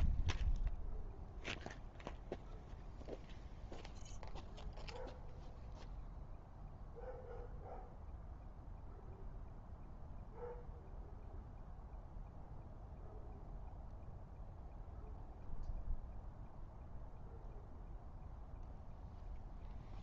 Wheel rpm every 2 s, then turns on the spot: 0, 0, 0, 0, 0, 0, 0, 0, 0, 0.
none